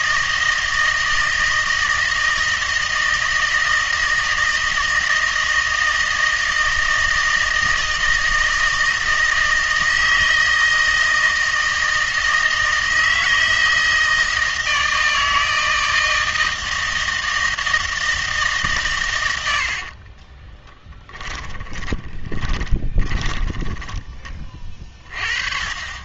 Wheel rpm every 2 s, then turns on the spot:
160, 160, 160, 160, 160, 160, 160, 160, 160, 120, 10, 20, 30.
20-24